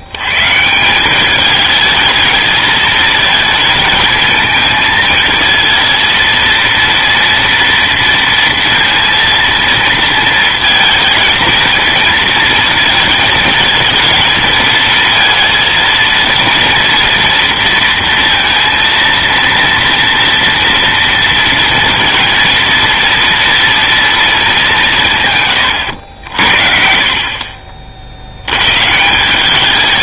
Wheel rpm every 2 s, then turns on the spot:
160, 220, 220, 230, 230, 220, 220, 230, 230, 230, 230, 230, 190, 60, 120.
none